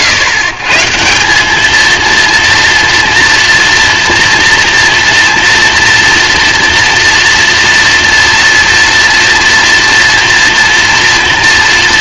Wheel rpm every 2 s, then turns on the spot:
130, 230, 230, 230, 230, 230.
none